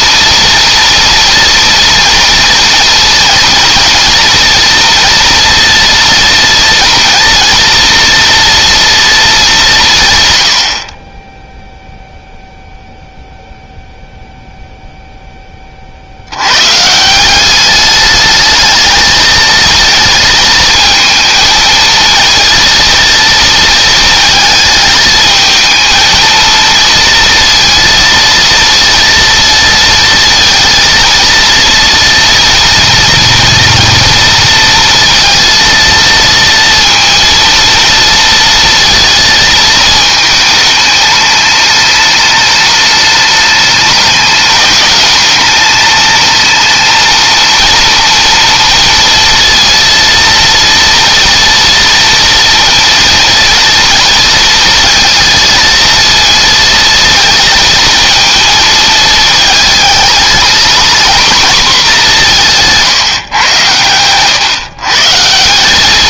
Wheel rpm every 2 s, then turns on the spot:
230, 240, 230, 230, 230, 60, 0, 0, 140, 220, 220, 230, 220, 230, 230, 230, 230, 230, 230, 230, 210, 210, 210, 230, 230, 230, 230, 220, 230, 220, 240, 150, 140.
none